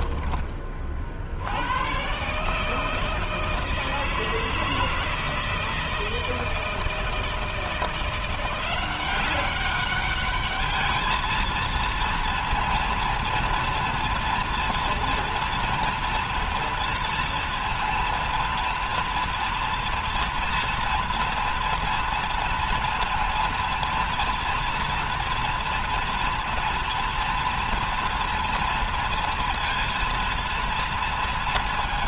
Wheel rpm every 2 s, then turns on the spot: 40, 150, 160, 160, 180, 220, 230, 230, 230, 230, 240, 230, 240, 230, 230, 230.
none